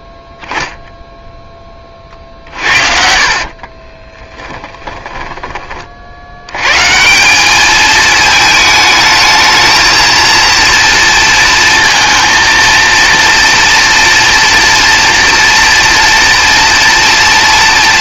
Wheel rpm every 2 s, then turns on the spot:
0, 60, 10, 130, 220, 230, 230, 230, 240.
2-6